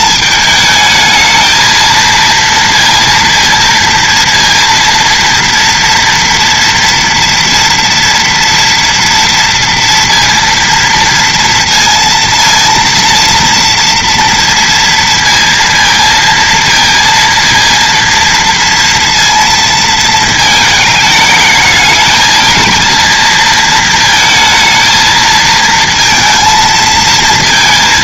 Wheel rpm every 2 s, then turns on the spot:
220, 230, 230, 230, 230, 230, 230, 230, 230, 230, 220, 220, 220, 230.
none